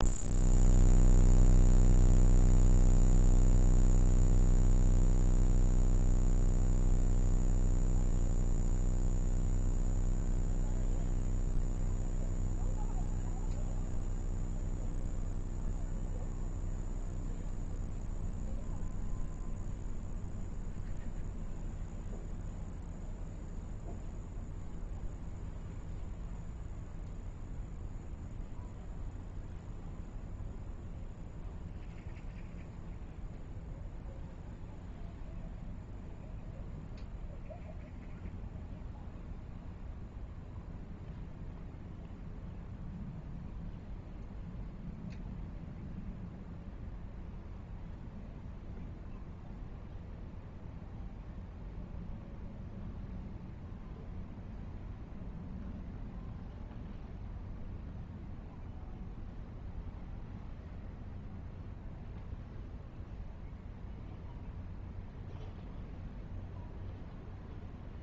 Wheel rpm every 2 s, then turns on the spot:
0, 0, 0, 0, 0, 0, 0, 0, 0, 0, 0, 0, 0, 0, 0, 0, 0, 0, 0, 0, 0, 0, 0, 0, 0, 0, 0, 0, 0, 0, 0, 0, 0, 0.
none